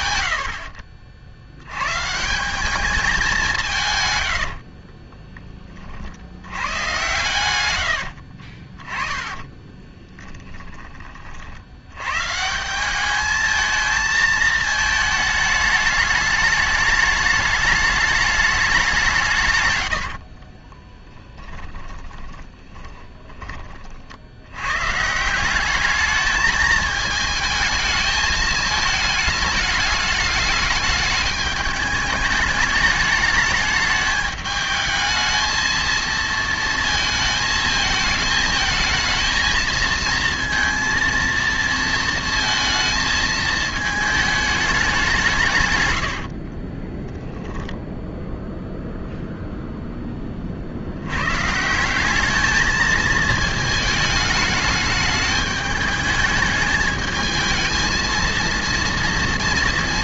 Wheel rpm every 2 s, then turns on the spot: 90, 210, 30, 110, 30, 20, 200, 220, 210, 190, 10, 40, 140, 220, 220, 210, 210, 220, 230, 220, 230, 230, 200, 20, 0, 80, 220, 210, 220, 230.
4-6 8-10 20-24 46-48